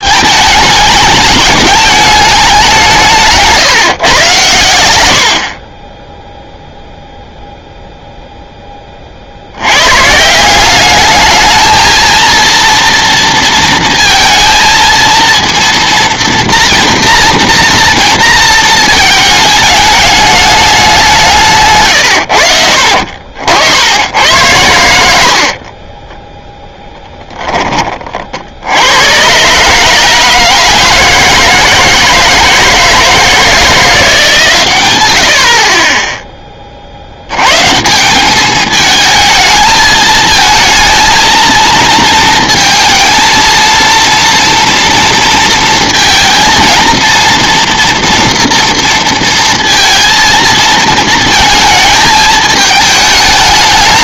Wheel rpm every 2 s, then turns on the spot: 220, 190, 100, 0, 20, 190, 230, 230, 230, 230, 200, 60, 90, 0, 80, 160, 160, 120, 30, 220, 220, 230, 230, 220, 230, 230, 220.
none